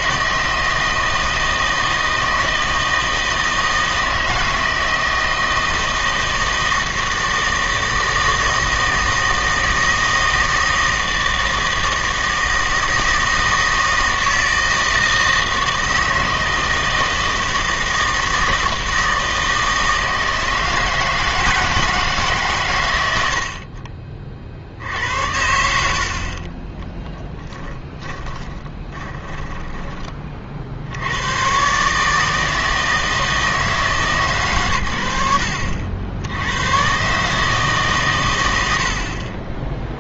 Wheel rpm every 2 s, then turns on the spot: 160, 160, 160, 160, 160, 160, 160, 160, 160, 160, 160, 110, 60, 10, 20, 60, 160, 100, 120, 80.
24-30